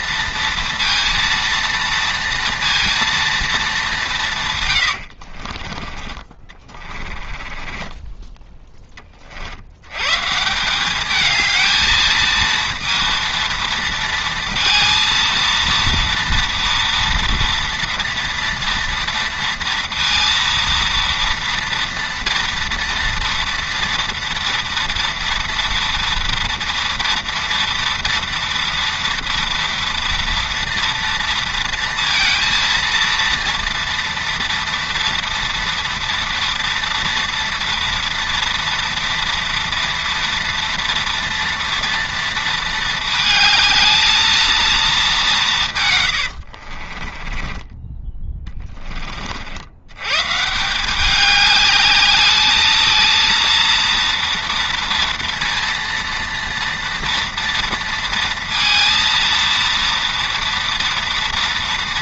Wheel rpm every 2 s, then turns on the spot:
230, 230, 100, 20, 20, 190, 230, 230, 230, 230, 230, 230, 230, 230, 230, 230, 230, 230, 230, 230, 230, 220, 220, 50, 20, 180, 220, 230, 230, 230, 230.
4-8 46-48